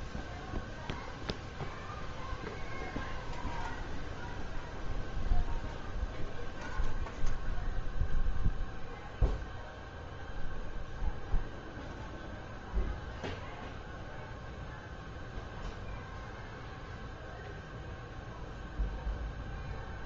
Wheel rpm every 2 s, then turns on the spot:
0, 0, 0, 0, 0, 0, 0, 0, 0, 0.
none